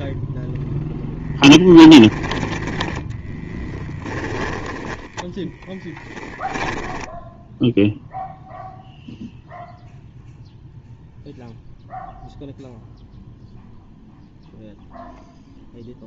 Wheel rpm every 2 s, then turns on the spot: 0, 10, 10, 10, 0, 0, 0, 0.
6-8